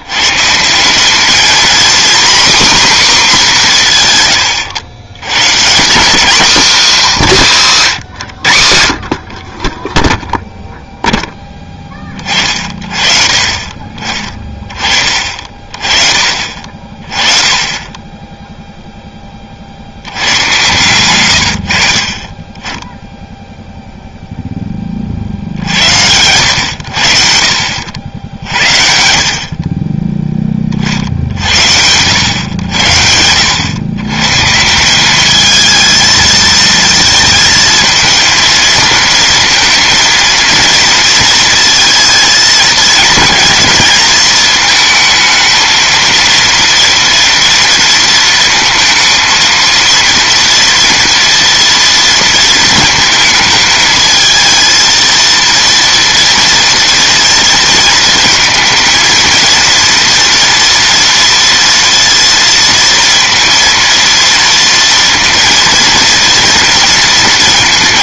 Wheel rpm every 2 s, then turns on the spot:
190, 270, 100, 240, 70, 0, 40, 30, 40, 0, 110, 20, 10, 90, 70, 30, 90, 160, 220, 220, 230, 220, 220, 230, 230, 230, 220, 230, 230, 220, 230, 230, 230, 230.
20-22